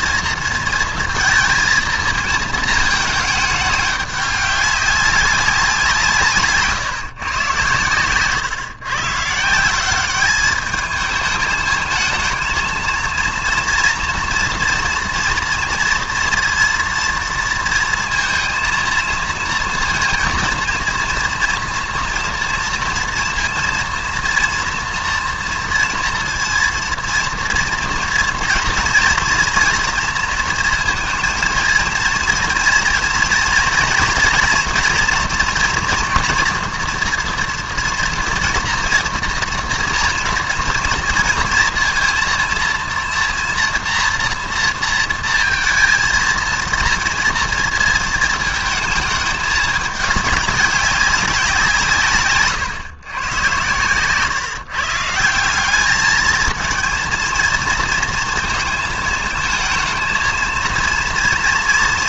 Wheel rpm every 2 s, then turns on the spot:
230, 220, 190, 150, 120, 210, 230, 230, 230, 230, 230, 230, 230, 230, 230, 230, 230, 230, 240, 230, 230, 230, 230, 230, 220, 200, 130, 130, 220, 230, 220.
6-8